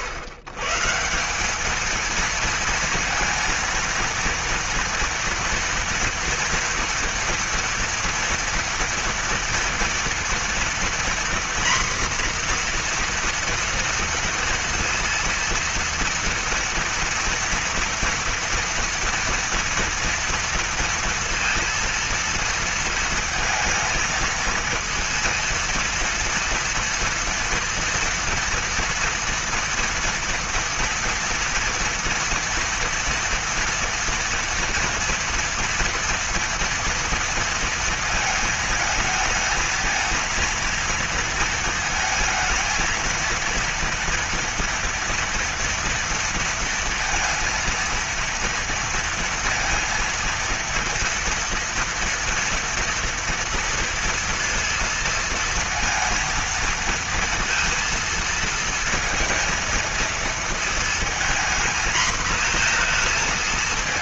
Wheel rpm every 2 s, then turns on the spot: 150, 230, 230, 230, 240, 240, 240, 230, 230, 230, 230, 230, 230, 230, 230, 240, 230, 230, 230, 220, 230, 230, 240, 230, 230, 230, 230, 230, 230, 230, 230, 230.
none